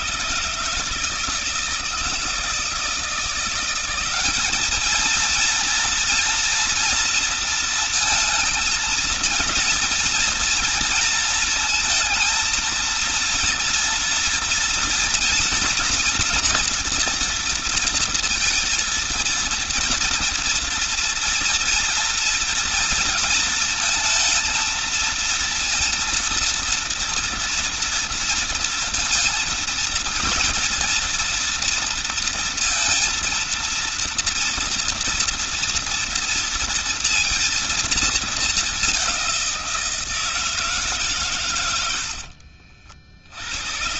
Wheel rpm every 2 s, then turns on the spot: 150, 170, 220, 230, 230, 230, 230, 240, 230, 230, 230, 230, 230, 230, 230, 240, 230, 230, 230, 200, 150, 60.
none